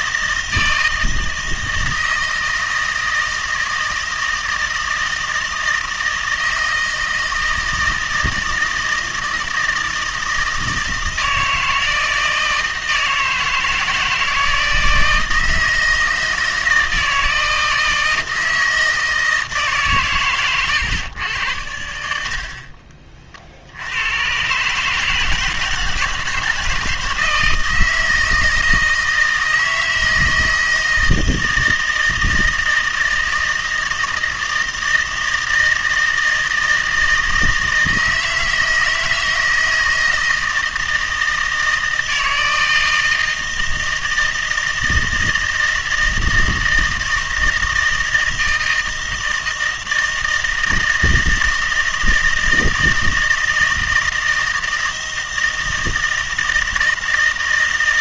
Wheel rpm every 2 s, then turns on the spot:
160, 160, 160, 160, 160, 160, 160, 160, 160, 160, 120, 40, 130, 160, 160, 160, 160, 160, 160, 160, 160, 160, 160, 160, 160, 160, 160, 160, 160.
none